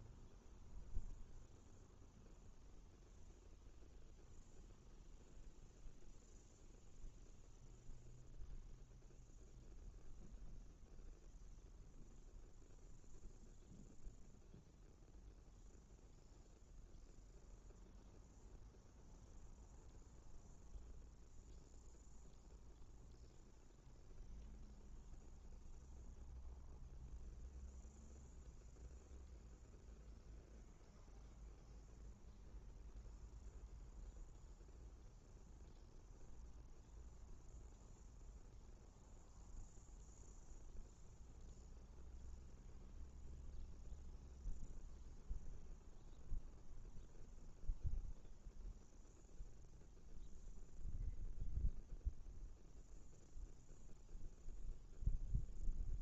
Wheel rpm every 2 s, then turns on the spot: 0, 0, 0, 0, 0, 0, 0, 0, 0, 0, 0, 0, 0, 0, 0, 0, 0, 0, 0, 0, 0, 0, 0, 0, 0, 0, 0, 0.
none